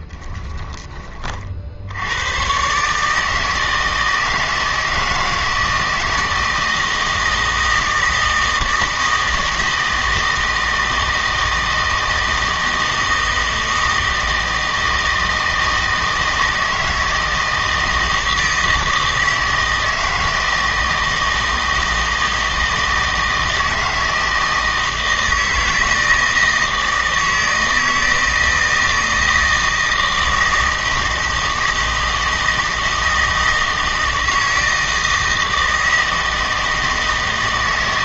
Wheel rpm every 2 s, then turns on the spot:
20, 130, 160, 160, 160, 160, 160, 160, 160, 160, 160, 160, 160, 160, 160, 160, 160, 160, 160.
none